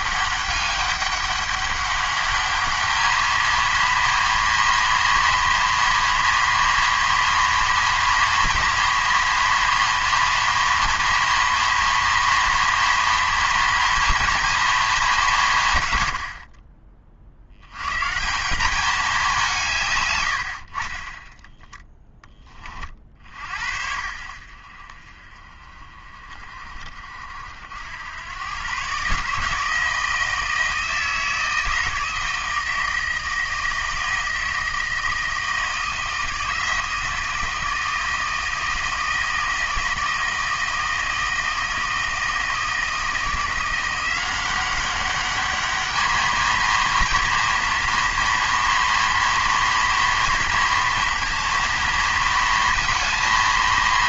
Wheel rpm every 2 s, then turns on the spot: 200, 210, 230, 230, 230, 230, 230, 220, 30, 180, 50, 30, 50, 40, 120, 160, 160, 160, 160, 160, 160, 160, 190, 230, 230, 230, 230.
none